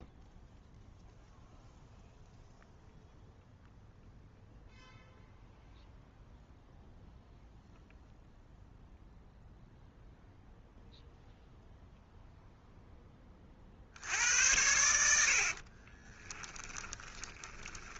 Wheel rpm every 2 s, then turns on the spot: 0, 0, 0, 0, 0, 0, 0, 80, 20.
16-18